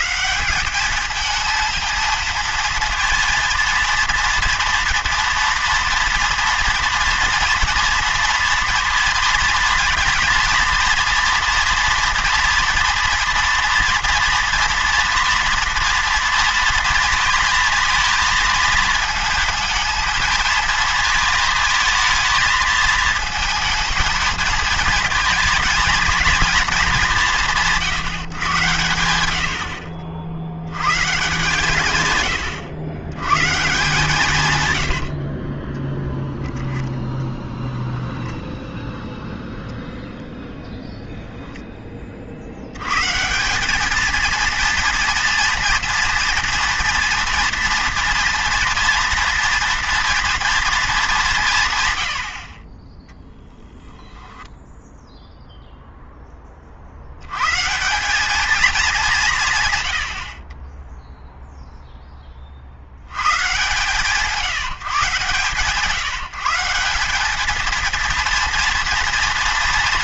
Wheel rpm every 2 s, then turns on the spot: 190, 230, 230, 230, 230, 230, 230, 230, 230, 220, 220, 220, 220, 220, 120, 80, 110, 110, 10, 10, 0, 70, 230, 230, 240, 230, 40, 0, 40, 220, 30, 40, 160, 170, 230.
32-38